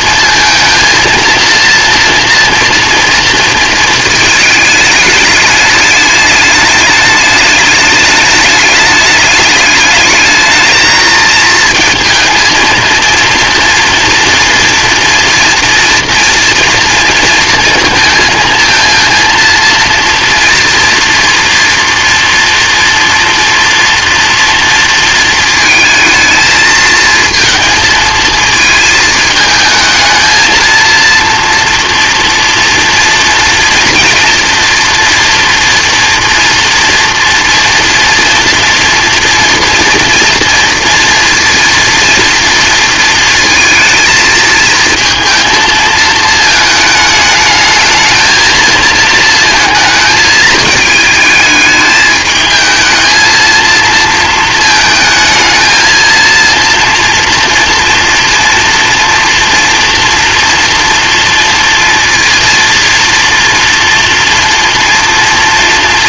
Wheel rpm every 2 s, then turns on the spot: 230, 230, 220, 210, 210, 220, 230, 230, 230, 230, 230, 230, 230, 230, 220, 230, 230, 230, 230, 230, 230, 230, 230, 220, 220, 220, 220, 220, 230, 230, 230, 230, 230.
none